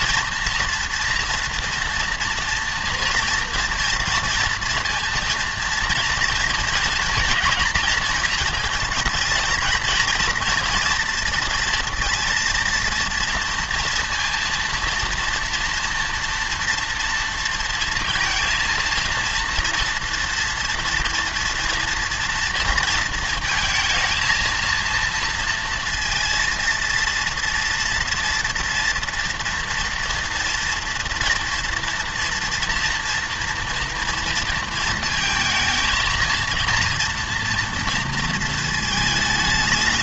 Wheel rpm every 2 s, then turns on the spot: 230, 230, 230, 230, 220, 240, 230, 230, 230, 230, 230, 230, 230, 230, 230, 230, 230, 230, 230, 220.
none